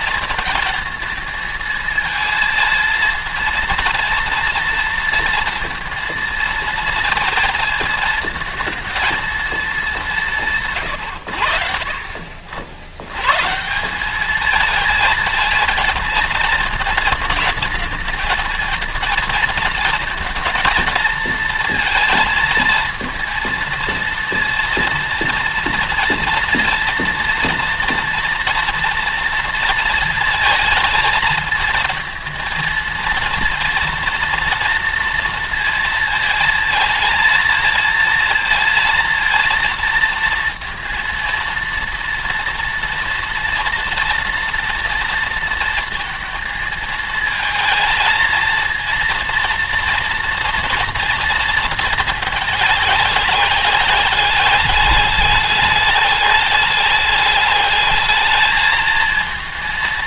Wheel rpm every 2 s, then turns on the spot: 220, 220, 230, 230, 220, 160, 70, 210, 220, 230, 220, 230, 230, 230, 230, 220, 230, 230, 230, 230, 230, 230, 230, 230, 220, 230, 210, 200, 210, 220.
none